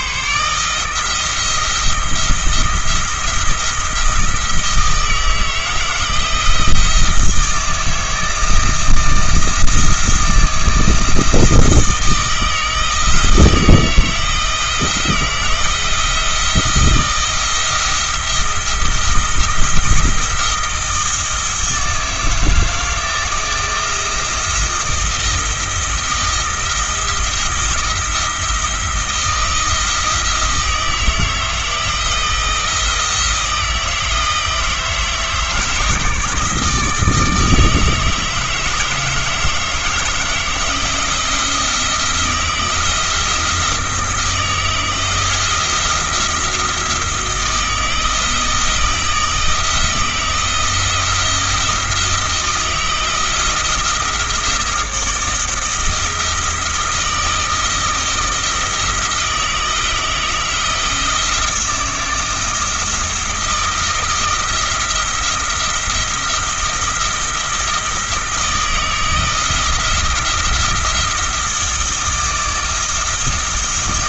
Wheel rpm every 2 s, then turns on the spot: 160, 170, 160, 160, 160, 160, 160, 170, 170, 170, 170, 160, 160, 170, 170, 160, 160, 160, 160, 160, 170, 170, 160, 170, 160, 170, 160, 160, 160, 160, 160, 160, 170, 170, 160, 170, 160.
none